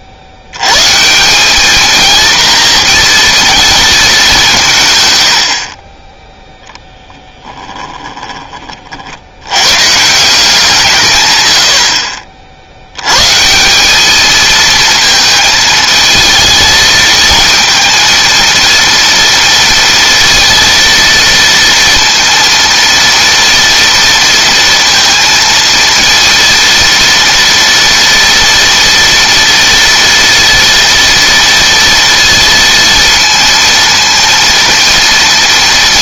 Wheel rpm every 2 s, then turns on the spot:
110, 230, 160, 10, 50, 160, 70, 220, 220, 230, 230, 230, 230, 230, 230, 230, 230, 230.
none